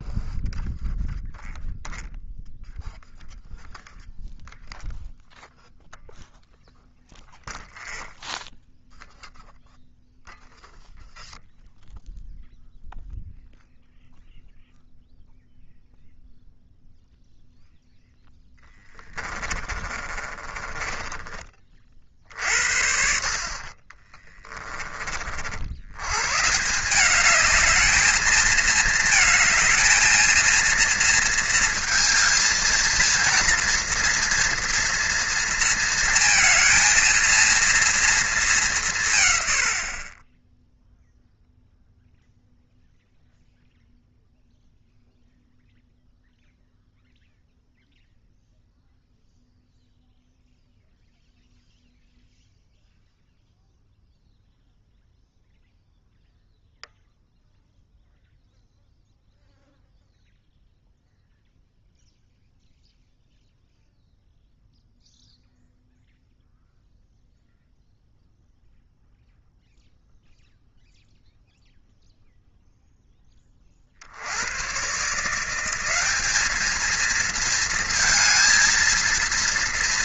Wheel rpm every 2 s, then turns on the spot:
0, 0, 0, 0, 0, 0, 0, 0, 0, 10, 30, 60, 30, 170, 220, 230, 230, 230, 230, 190, 10, 0, 0, 0, 0, 0, 0, 0, 0, 0, 0, 0, 0, 0, 0, 0, 0, 120, 210, 230.
18-22